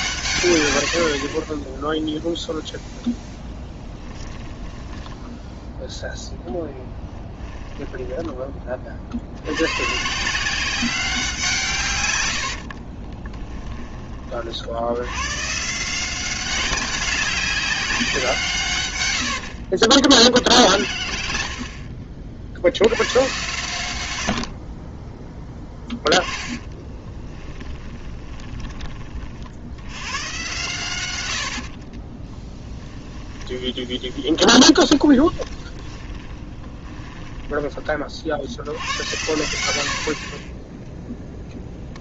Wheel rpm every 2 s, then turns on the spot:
100, 10, 10, 0, 30, 180, 60, 70, 190, 140, 50, 70, 40, 10, 10, 120, 10, 20, 30, 80, 20.
4-6 12-14 20-22 26-28 32-38